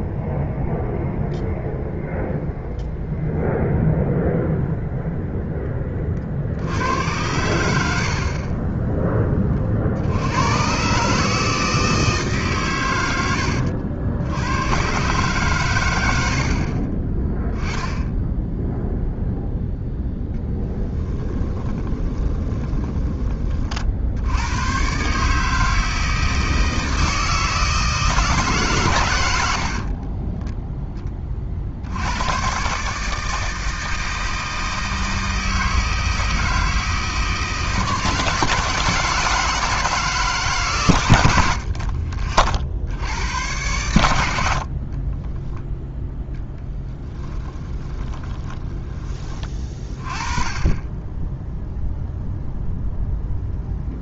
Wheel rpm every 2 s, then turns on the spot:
0, 0, 0, 70, 20, 110, 130, 110, 50, 0, 10, 20, 110, 160, 140, 10, 130, 160, 160, 160, 130, 60, 60, 10, 10, 20, 0.
16-18 20-24 46-48